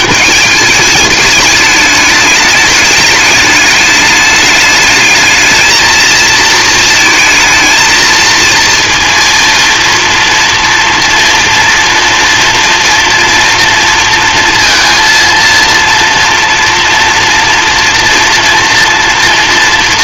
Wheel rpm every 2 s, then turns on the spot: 210, 210, 210, 220, 230, 230, 230, 230, 230, 230.
none